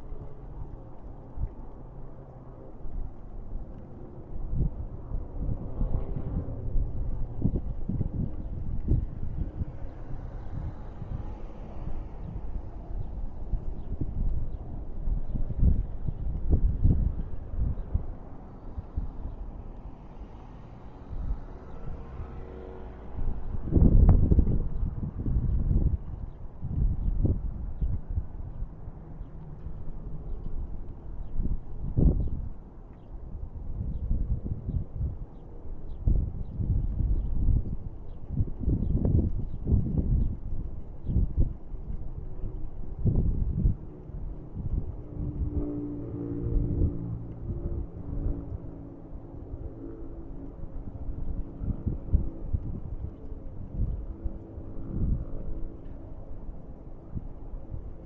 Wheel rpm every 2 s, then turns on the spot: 0, 0, 0, 0, 0, 0, 0, 0, 0, 0, 0, 0, 0, 0, 0, 0, 0, 0, 0, 0, 0, 0, 0, 0, 0, 0, 0, 0, 0.
none